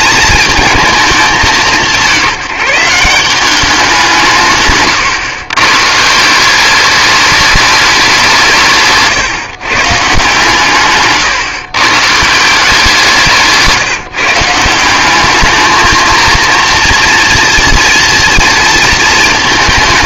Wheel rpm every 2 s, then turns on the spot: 230, 180, 140, 180, 170, 140, 170, 160, 230, 230.
none